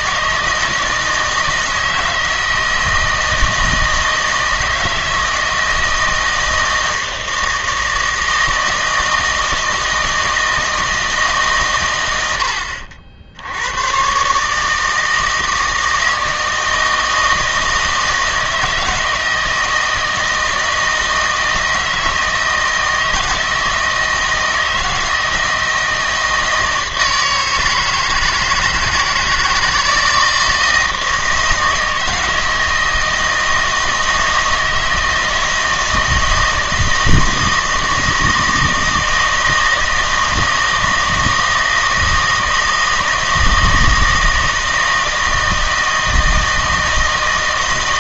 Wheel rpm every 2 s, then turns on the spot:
160, 160, 160, 160, 160, 160, 80, 150, 160, 160, 160, 160, 160, 160, 160, 160, 160, 160, 160, 160, 160, 160, 160, 160.
none